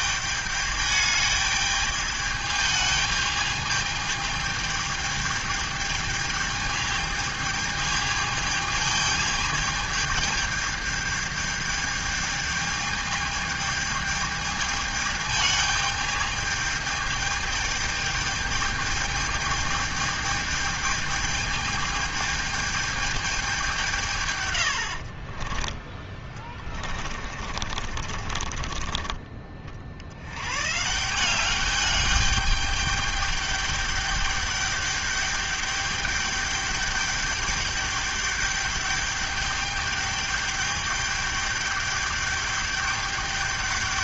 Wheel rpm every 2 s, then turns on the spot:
210, 210, 220, 210, 220, 210, 210, 210, 210, 210, 210, 210, 120, 20, 40, 90, 210, 210, 210, 210, 210, 210.
26-30